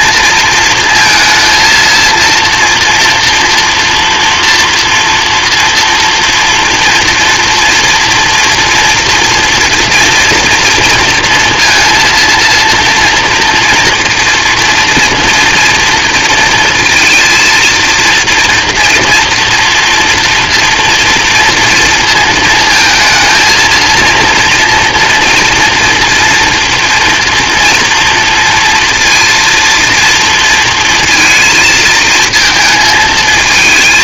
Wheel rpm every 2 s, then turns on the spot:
230, 230, 230, 230, 230, 230, 230, 230, 230, 230, 230, 220, 230, 230, 230, 230, 220.
none